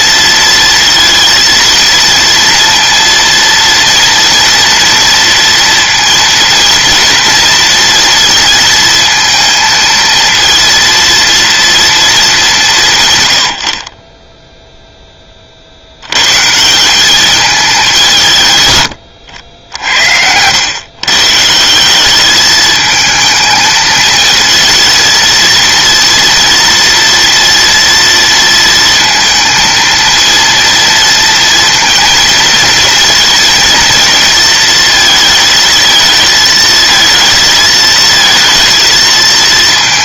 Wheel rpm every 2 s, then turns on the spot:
230, 230, 230, 240, 230, 230, 160, 0, 170, 110, 100, 220, 230, 230, 230, 230, 230, 220, 220, 230.
none